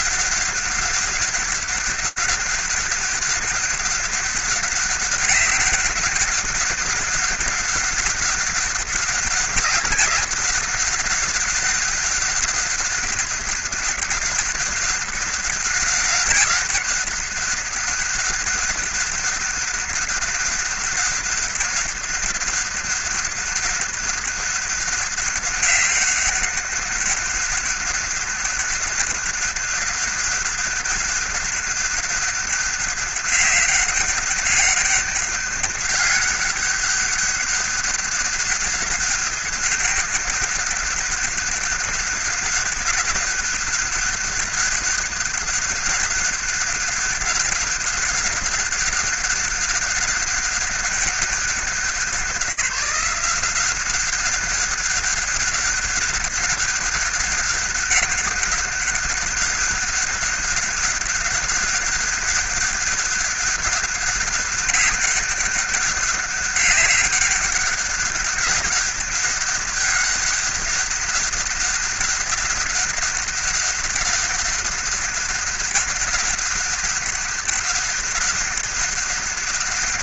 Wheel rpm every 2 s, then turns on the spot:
200, 200, 200, 200, 200, 200, 200, 200, 200, 200, 200, 200, 200, 200, 200, 200, 190, 200, 200, 200, 200, 200, 200, 200, 200, 200, 180, 190, 200, 200, 200, 200, 200, 200, 190, 200, 200, 200, 200, 200.
none